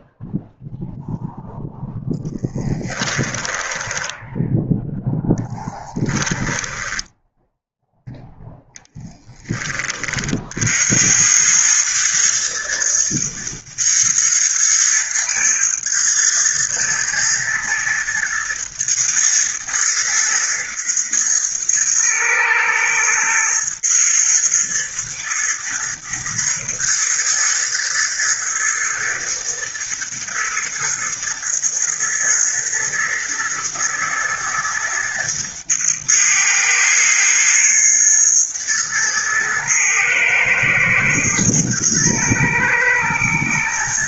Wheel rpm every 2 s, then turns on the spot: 0, 10, 0, 10, 0, 80, 110, 110, 120, 120, 110, 120, 120, 120, 110, 110, 110, 110, 110, 110, 110, 120.
2-4 6-8